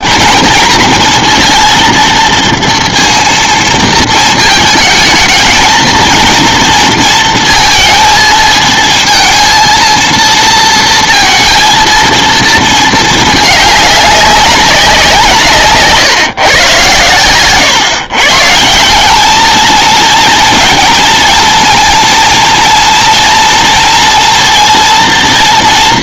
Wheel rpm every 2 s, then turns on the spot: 230, 230, 220, 230, 220, 230, 220, 190, 120, 160, 230, 230, 230.
none